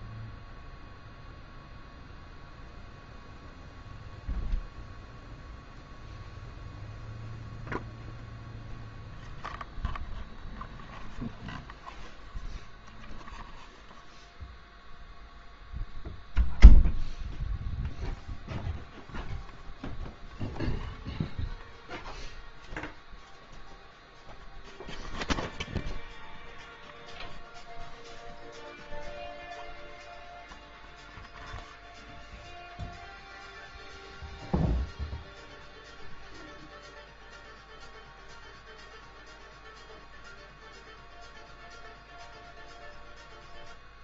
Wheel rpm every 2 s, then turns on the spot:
0, 0, 0, 0, 0, 0, 0, 0, 0, 0, 0, 0, 0, 0, 0, 0, 0, 0, 0, 0, 0, 0.
none